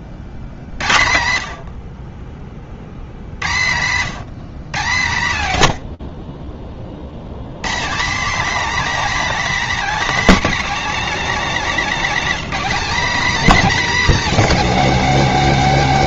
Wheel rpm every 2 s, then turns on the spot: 80, 70, 150, 70, 280, 260, 260, 250.
none